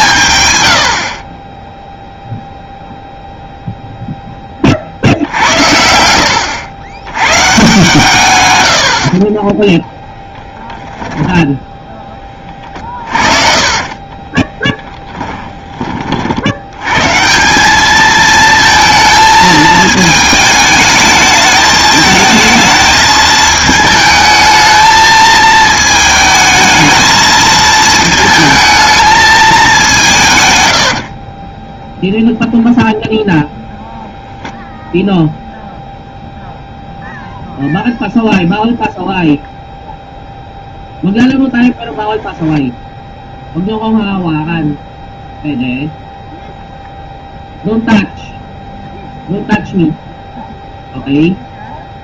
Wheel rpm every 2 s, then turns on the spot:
80, 0, 60, 100, 80, 10, 30, 10, 110, 220, 220, 220, 220, 220, 220, 70, 0, 0, 0, 0, 0, 0, 0, 0, 0, 0.
10-16 30-32